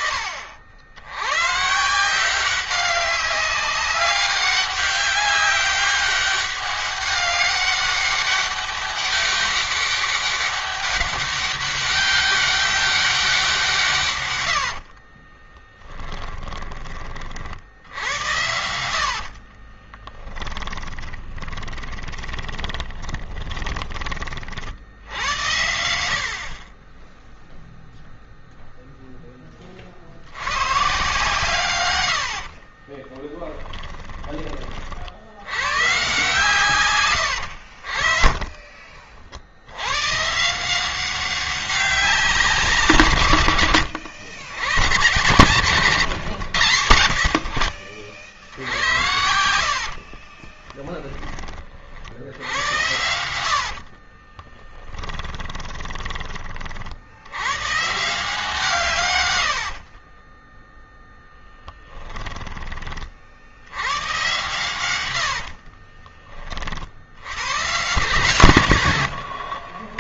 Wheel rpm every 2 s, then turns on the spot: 90, 190, 200, 200, 200, 200, 190, 50, 30, 70, 20, 20, 70, 20, 0, 140, 30, 60, 110, 50, 180, 140, 110, 90, 90, 20, 100, 10, 70, 130, 0, 30, 100, 70, 110.
14-16 18-24 32-34 48-56 64-66 68-70